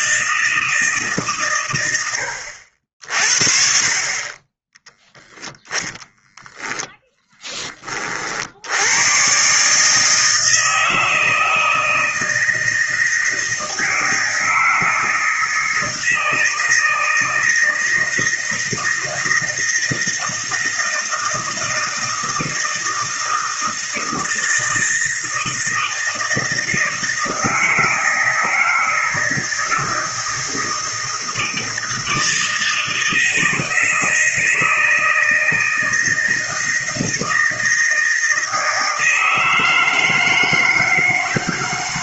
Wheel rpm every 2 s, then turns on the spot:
160, 70, 20, 10, 90, 160, 160, 160, 160, 160, 160, 160, 160, 160, 160, 160, 160, 160, 160, 160, 160.
6-8